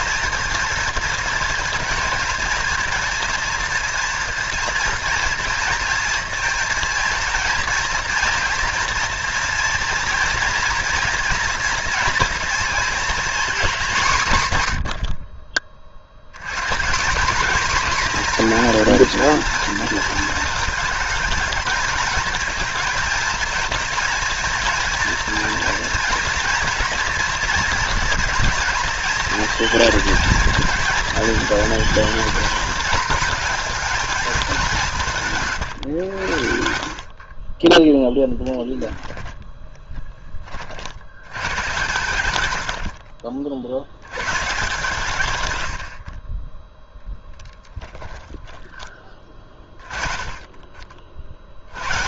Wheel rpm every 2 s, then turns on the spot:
230, 230, 240, 230, 240, 230, 240, 120, 160, 240, 230, 230, 230, 230, 240, 230, 220, 200, 70, 10, 50, 80, 150, 10, 20, 30.
38-40 42-44 48-50